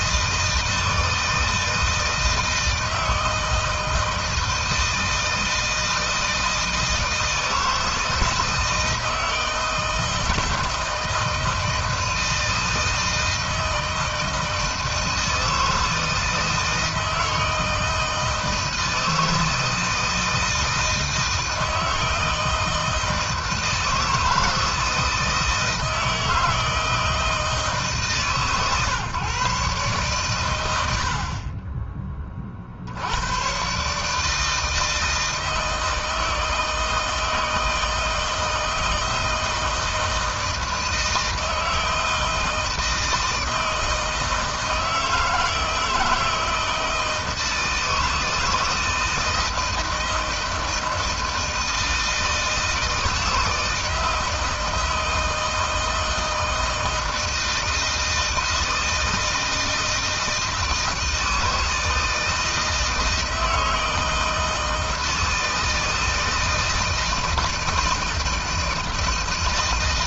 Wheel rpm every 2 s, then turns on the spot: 160, 160, 160, 160, 160, 160, 160, 160, 160, 160, 160, 160, 160, 160, 140, 90, 50, 160, 160, 160, 160, 160, 160, 160, 160, 160, 160, 160, 160, 160, 160, 160, 160, 160, 160.
none